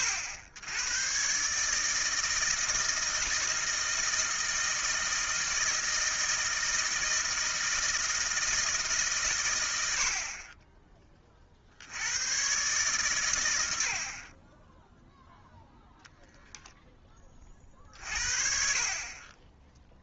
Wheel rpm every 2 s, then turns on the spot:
90, 160, 160, 160, 160, 20, 130, 20, 10, 50.
none